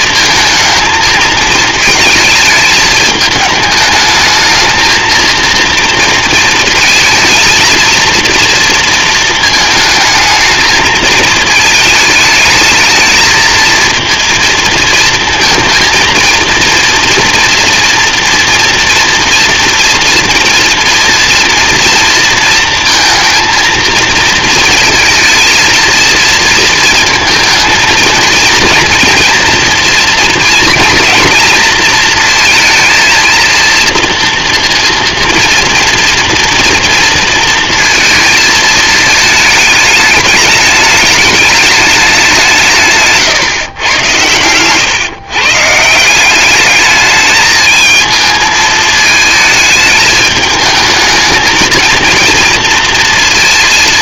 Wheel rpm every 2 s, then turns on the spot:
220, 220, 220, 220, 230, 220, 210, 230, 230, 230, 230, 230, 230, 230, 220, 230, 230, 230, 230, 220, 210, 180, 110, 190, 220, 220, 230.
none